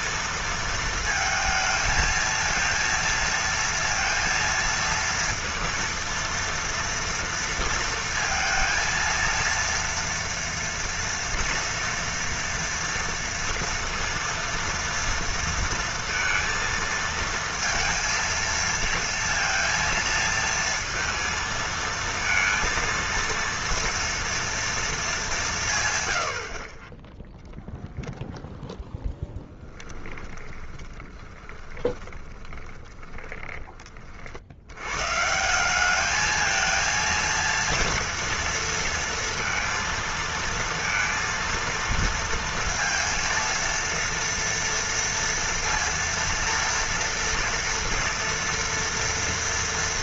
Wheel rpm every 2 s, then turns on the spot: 230, 230, 230, 230, 230, 230, 230, 230, 230, 230, 230, 230, 230, 30, 0, 20, 20, 100, 230, 230, 230, 230, 230, 230, 230.
30-34